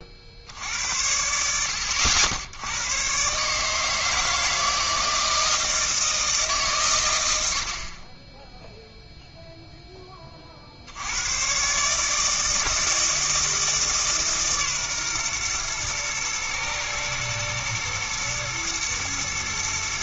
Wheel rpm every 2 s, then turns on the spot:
70, 90, 160, 140, 10, 40, 160, 140, 110, 120.
none